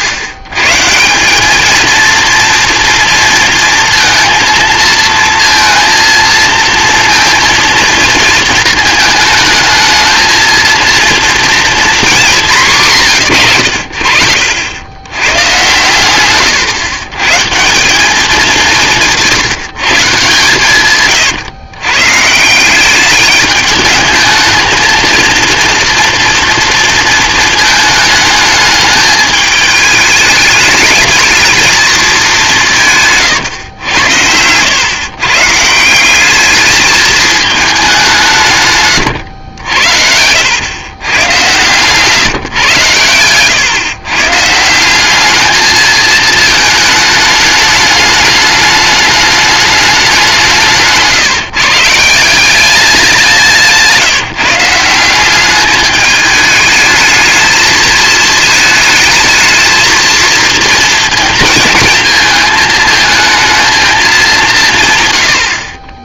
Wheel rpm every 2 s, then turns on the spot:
130, 230, 230, 230, 220, 230, 180, 80, 120, 190, 140, 180, 220, 230, 220, 210, 200, 100, 210, 130, 110, 130, 150, 220, 210, 170, 190, 150, 210, 220, 230, 220, 190.
none